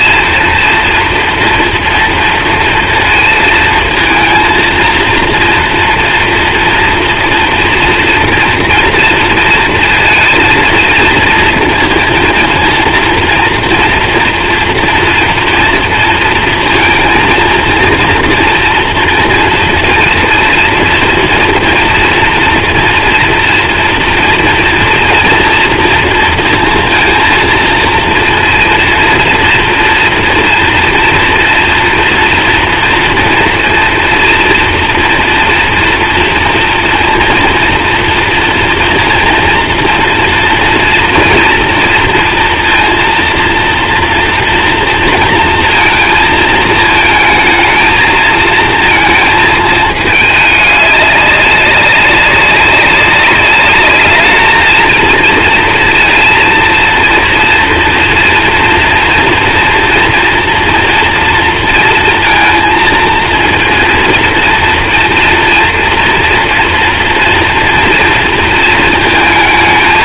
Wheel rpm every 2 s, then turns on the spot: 230, 230, 230, 230, 230, 230, 230, 230, 230, 240, 230, 230, 230, 230, 230, 240, 230, 230, 230, 230, 230, 230, 230, 230, 230, 210, 200, 220, 230, 230, 230, 230, 230, 230, 230.
none